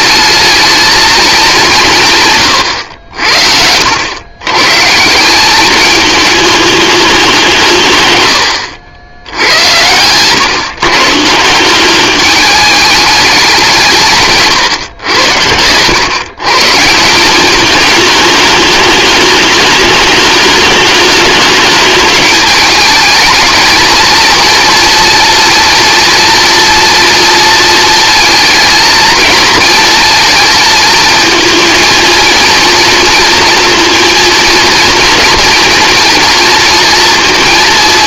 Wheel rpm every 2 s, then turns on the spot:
220, 110, 130, 210, 80, 140, 210, 120, 150, 210, 220, 210, 230, 230, 230, 230, 230, 230, 230.
none